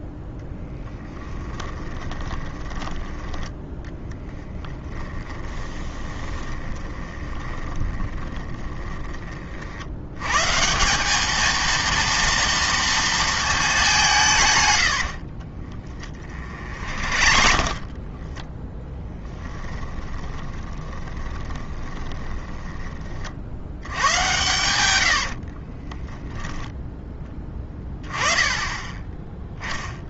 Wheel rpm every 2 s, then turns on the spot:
10, 20, 20, 20, 10, 160, 230, 110, 50, 10, 20, 20, 90, 0, 20.
0-10 14-18 20-22 24-26